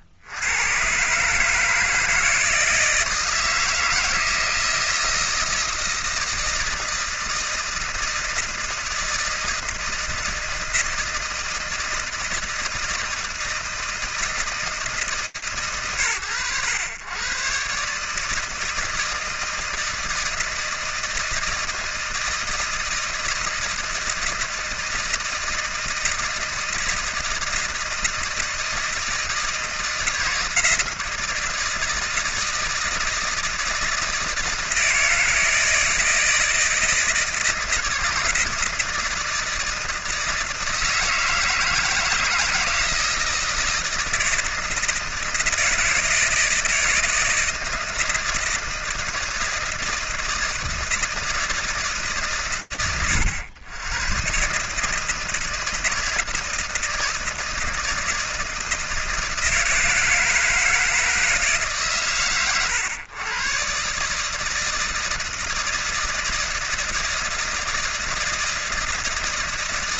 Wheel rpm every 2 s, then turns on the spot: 80, 160, 160, 160, 160, 160, 160, 160, 120, 150, 160, 160, 160, 160, 160, 160, 160, 160, 160, 160, 160, 160, 160, 160, 160, 160, 120, 120, 160, 160, 160, 120, 150, 160, 160.
none